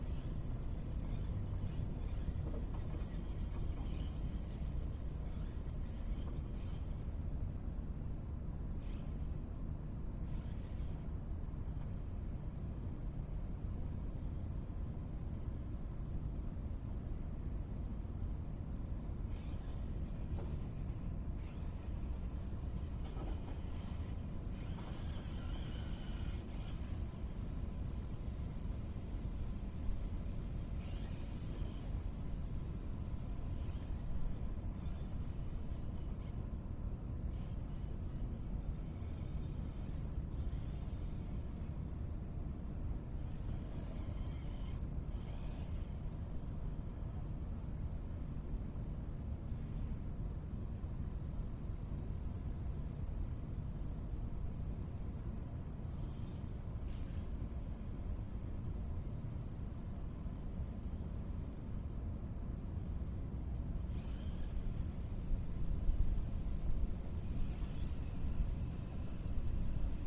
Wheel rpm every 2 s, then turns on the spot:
0, 0, 0, 0, 0, 0, 0, 0, 0, 0, 0, 0, 0, 0, 0, 0, 0, 0, 0, 0, 0, 0, 0, 0, 0, 0, 0, 0, 0, 0, 0, 0, 0, 0, 0.
none